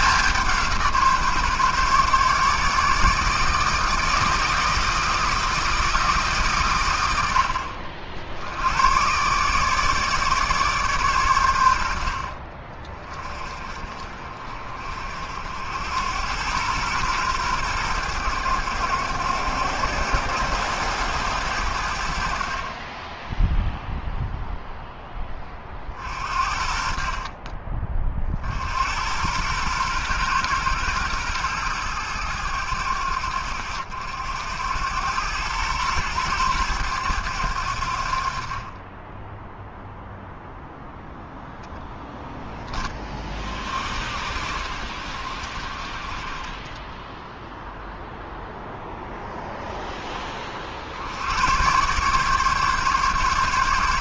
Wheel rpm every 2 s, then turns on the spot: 160, 150, 160, 110, 120, 140, 30, 50, 120, 100, 110, 20, 10, 50, 90, 120, 90, 90, 100, 20, 0, 20, 60, 10, 0, 80, 140.
none